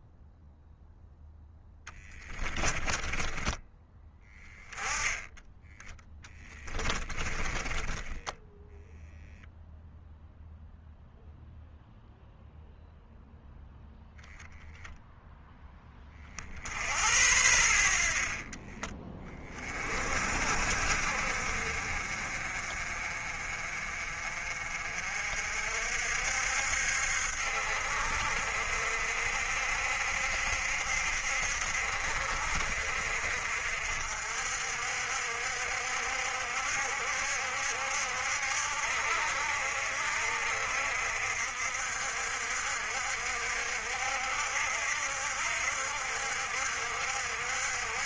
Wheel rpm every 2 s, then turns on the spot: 0, 10, 10, 20, 0, 0, 0, 0, 60, 20, 60, 40, 50, 70, 60, 60, 60, 60, 70, 70, 60, 60, 60, 60.
6-8